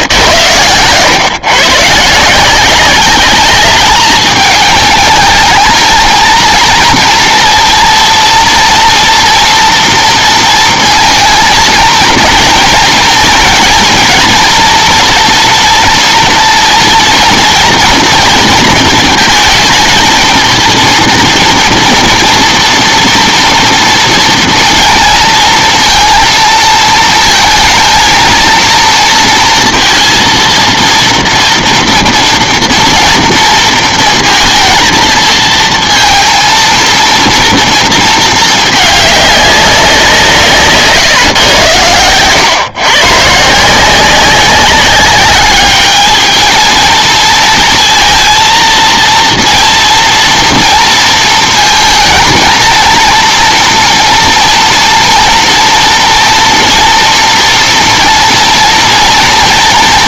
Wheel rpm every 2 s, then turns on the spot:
110, 180, 220, 230, 240, 230, 230, 230, 240, 230, 230, 230, 230, 230, 230, 230, 230, 220, 230, 210, 140, 120, 190, 220, 230, 230, 230, 230, 230, 230.
none